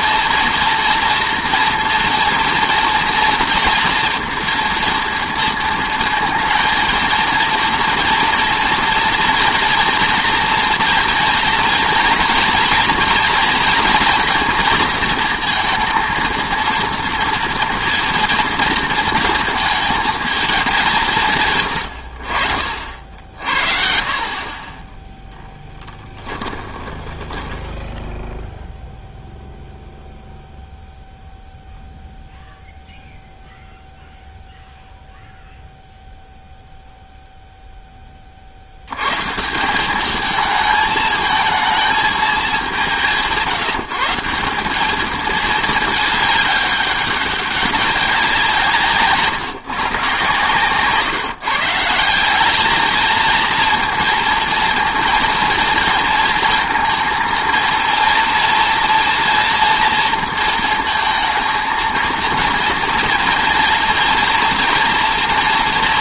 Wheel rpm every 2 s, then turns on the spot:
240, 230, 230, 220, 230, 230, 240, 230, 230, 230, 210, 50, 30, 20, 0, 0, 0, 0, 0, 70, 220, 200, 190, 200, 160, 130, 210, 230, 230, 230, 230, 230, 230.
26-28